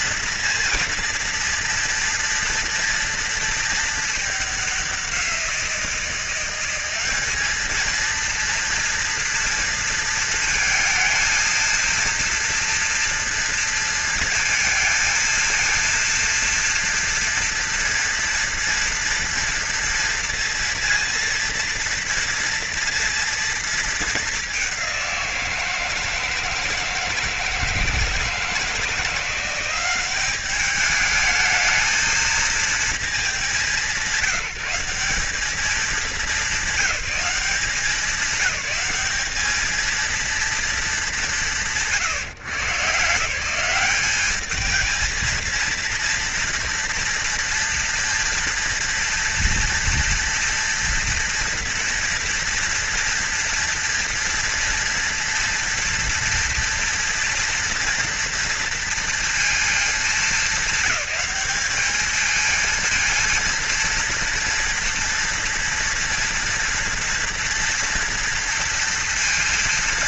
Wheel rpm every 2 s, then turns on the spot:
230, 230, 200, 180, 230, 230, 230, 230, 230, 230, 230, 230, 210, 160, 160, 200, 230, 190, 210, 200, 230, 150, 210, 230, 230, 230, 230, 230, 230, 230, 220, 220, 230, 240, 230.
none